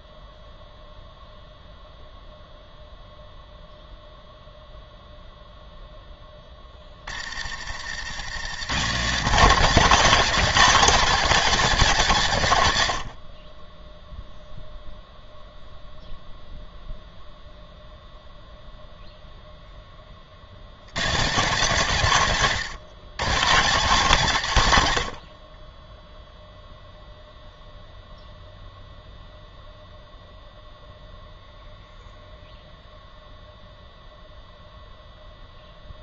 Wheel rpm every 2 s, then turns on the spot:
0, 0, 0, 30, 140, 210, 110, 0, 0, 0, 80, 120, 120, 0, 0, 0, 0, 0.
6-8